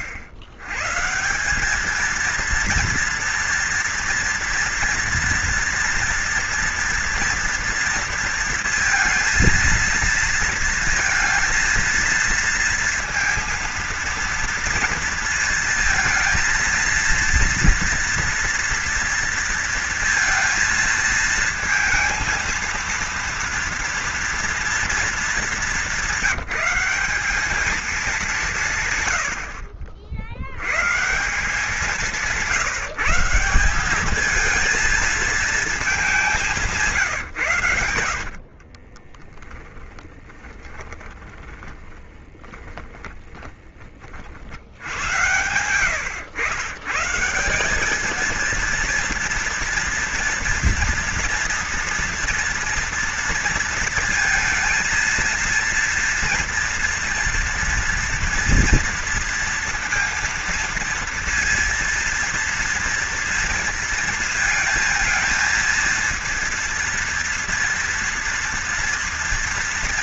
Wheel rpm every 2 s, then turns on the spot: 110, 230, 230, 230, 230, 230, 230, 230, 230, 230, 230, 230, 230, 180, 150, 100, 160, 220, 190, 50, 20, 10, 60, 120, 230, 230, 230, 230, 230, 230, 230, 230, 230, 230, 240.
38-44